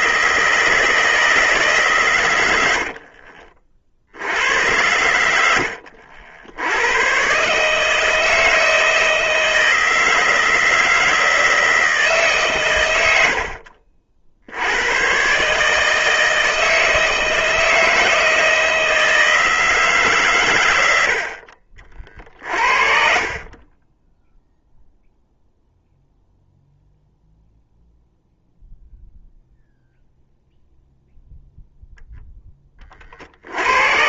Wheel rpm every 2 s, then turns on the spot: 160, 90, 80, 100, 160, 160, 120, 80, 160, 160, 100, 40, 0, 0, 0, 0, 20.
2-4